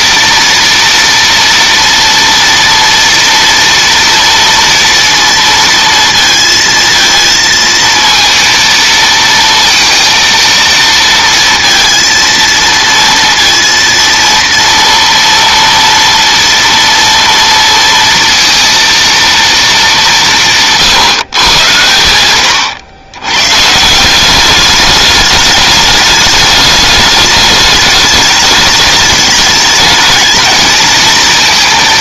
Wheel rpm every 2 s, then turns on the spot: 230, 230, 230, 230, 230, 230, 230, 230, 230, 230, 190, 110, 180, 210, 210, 220.
none